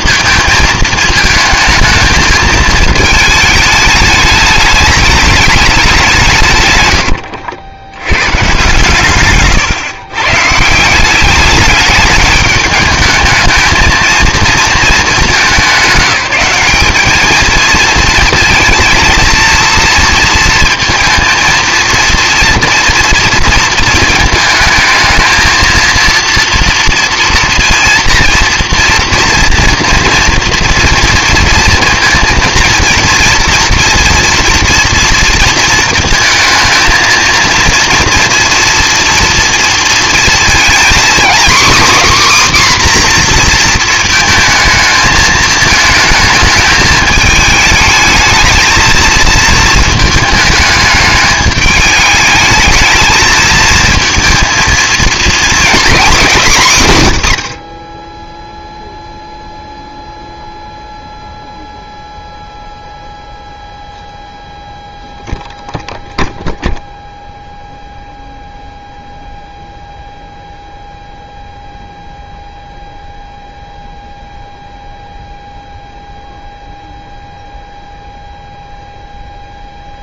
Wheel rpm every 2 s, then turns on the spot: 220, 220, 210, 130, 110, 170, 210, 210, 200, 230, 230, 230, 220, 230, 230, 230, 230, 240, 220, 240, 240, 270, 220, 220, 220, 210, 220, 230, 180, 0, 0, 0, 0, 0, 0, 0, 0, 0, 0, 0.
none